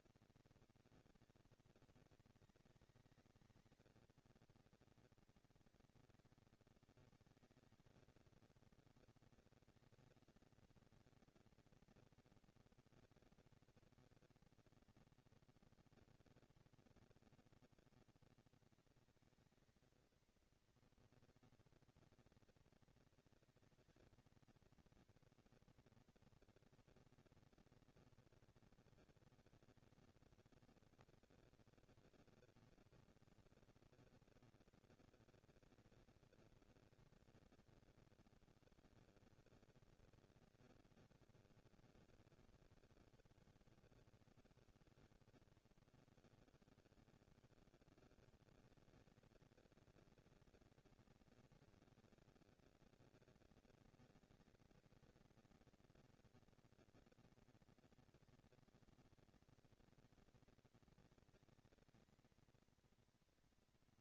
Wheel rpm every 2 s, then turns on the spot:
210, 210, 220, 210, 230, 230, 230, 230, 230, 220, 230, 230, 240, 230, 220, 230, 230, 230, 210, 190, 200, 140, 100, 160, 210, 220, 230, 230, 230, 230, 220, 220.
none